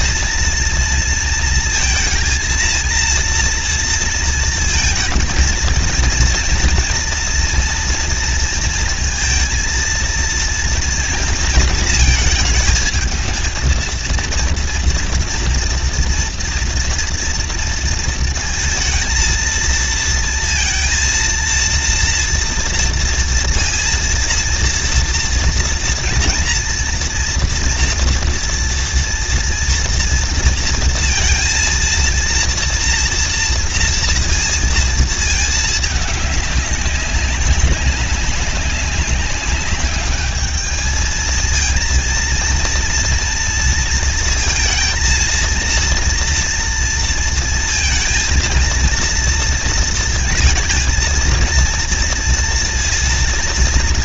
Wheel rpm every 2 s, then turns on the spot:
230, 230, 230, 230, 230, 230, 220, 230, 240, 230, 230, 230, 230, 230, 230, 230, 230, 230, 210, 200, 210, 230, 230, 230, 230, 230, 230.
none